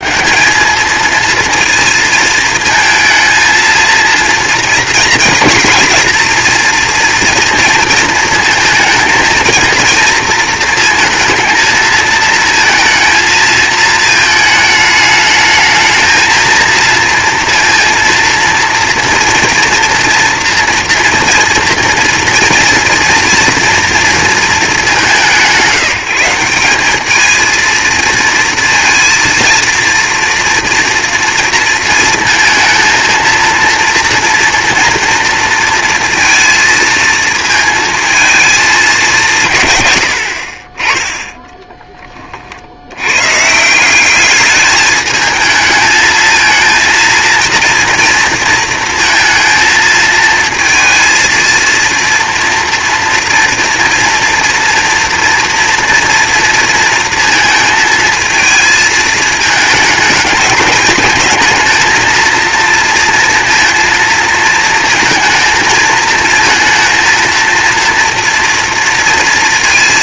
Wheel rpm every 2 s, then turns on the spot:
220, 230, 230, 240, 230, 230, 220, 210, 230, 230, 240, 230, 180, 210, 230, 230, 230, 230, 220, 170, 10, 100, 220, 230, 230, 230, 240, 240, 230, 220, 220, 230, 230, 230, 230.
none